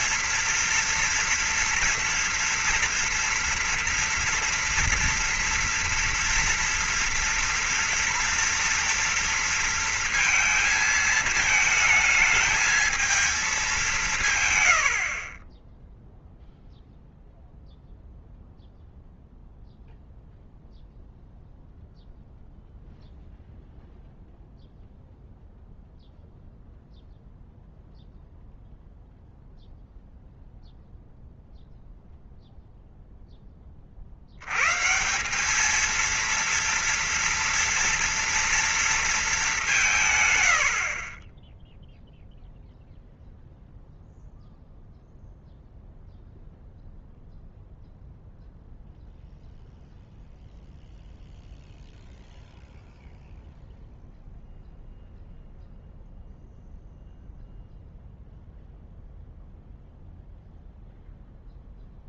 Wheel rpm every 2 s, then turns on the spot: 240, 240, 230, 230, 230, 220, 220, 70, 0, 0, 0, 0, 0, 0, 0, 0, 0, 160, 230, 220, 50, 0, 0, 0, 0, 0, 0, 0, 0, 0, 0.
none